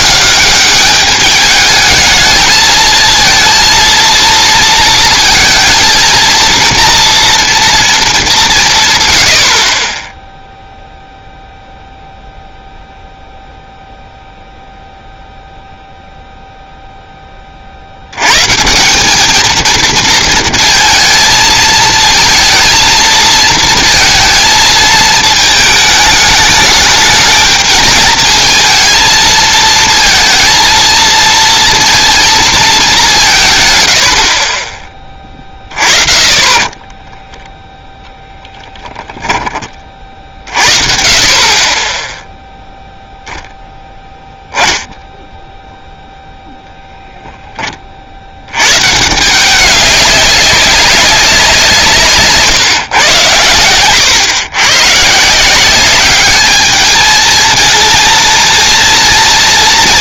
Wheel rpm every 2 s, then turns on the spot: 210, 220, 230, 230, 110, 0, 0, 0, 10, 190, 230, 230, 220, 210, 230, 230, 190, 20, 10, 20, 40, 0, 10, 0, 110, 190, 140, 120, 210, 230.
36-40